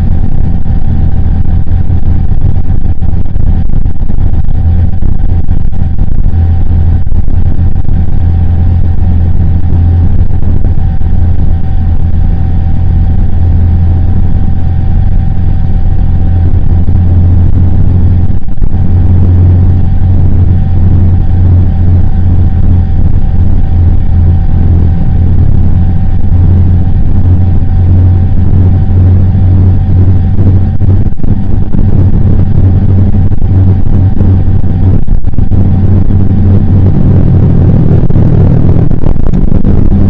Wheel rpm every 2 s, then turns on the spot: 0, 0, 0, 0, 0, 0, 0, 0, 0, 0, 0, 0, 0, 0, 0, 0, 0, 0, 0, 0.
none